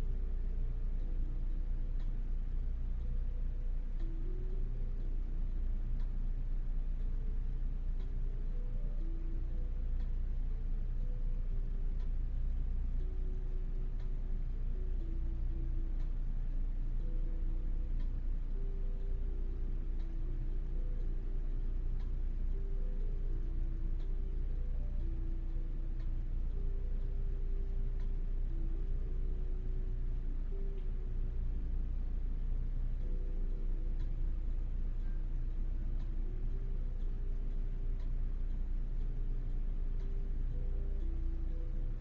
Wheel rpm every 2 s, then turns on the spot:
0, 0, 0, 0, 0, 0, 0, 0, 0, 0, 0, 0, 0, 0, 0, 0, 0, 0, 0, 0, 0.
none